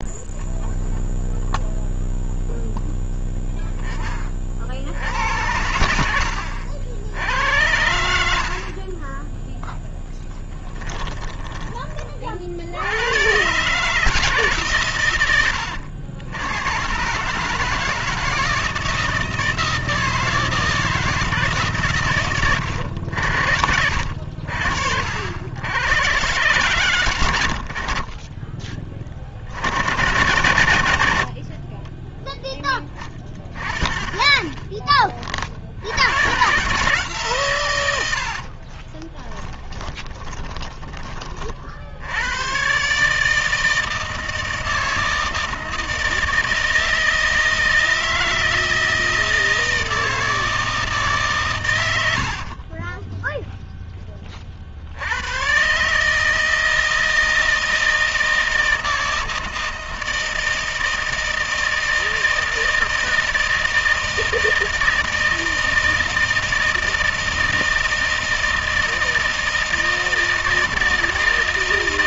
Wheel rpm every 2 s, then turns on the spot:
0, 0, 40, 80, 60, 20, 50, 150, 100, 160, 160, 110, 60, 130, 30, 100, 10, 10, 140, 40, 20, 120, 160, 160, 160, 160, 50, 40, 160, 160, 160, 160, 160, 160, 160, 160.
10-12 38-42 52-54